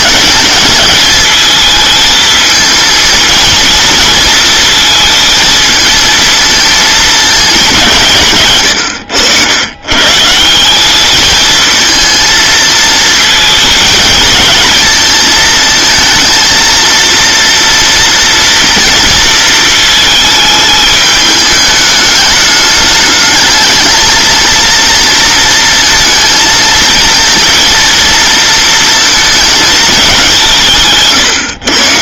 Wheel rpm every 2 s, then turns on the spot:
220, 220, 230, 220, 130, 170, 220, 220, 230, 230, 220, 210, 220, 230, 230, 170.
none